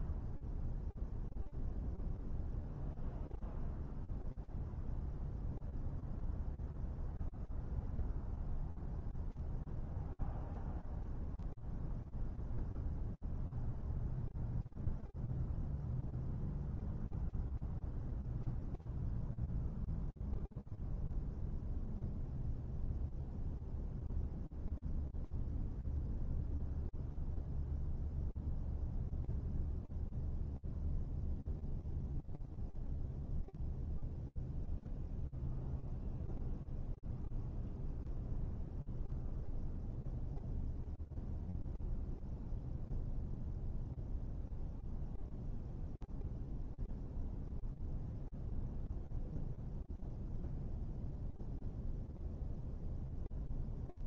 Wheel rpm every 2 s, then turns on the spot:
0, 0, 0, 0, 0, 0, 0, 0, 0, 0, 0, 0, 0, 0, 0, 0, 0, 0, 0, 0, 0, 0, 0, 0, 0, 0, 0.
none